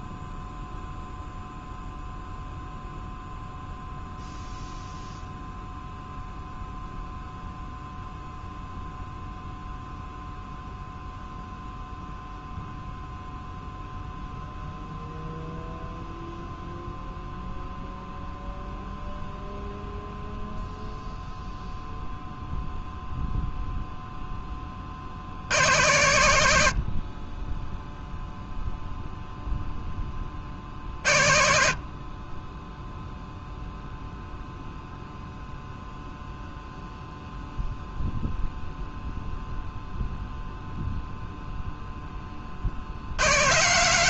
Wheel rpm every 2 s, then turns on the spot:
0, 0, 0, 0, 0, 0, 0, 0, 0, 0, 0, 0, 30, 50, 0, 50, 0, 0, 0, 0, 0, 60.
none